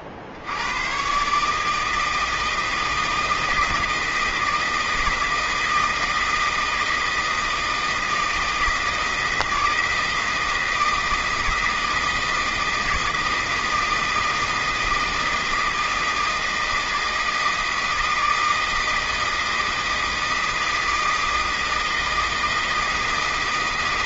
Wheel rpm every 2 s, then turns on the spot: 90, 160, 160, 160, 160, 160, 160, 160, 160, 160, 160, 160.
none